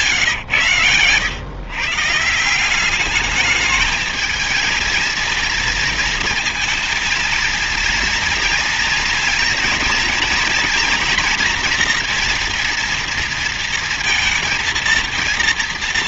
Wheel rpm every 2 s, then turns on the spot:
130, 180, 230, 230, 230, 240, 240, 230.
none